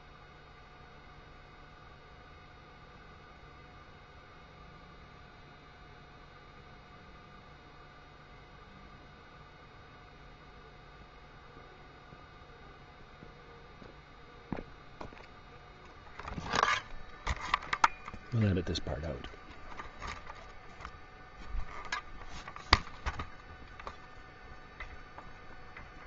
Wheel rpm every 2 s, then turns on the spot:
0, 0, 0, 0, 0, 0, 0, 0, 0, 0, 0, 0, 0.
none